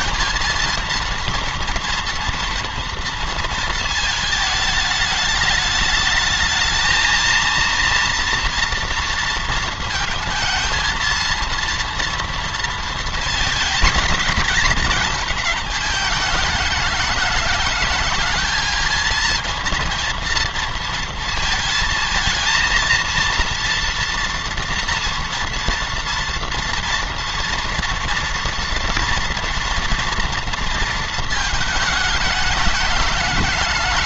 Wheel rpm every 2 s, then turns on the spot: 230, 230, 210, 220, 240, 220, 230, 220, 210, 230, 230, 220, 230, 230, 230, 230, 210.
none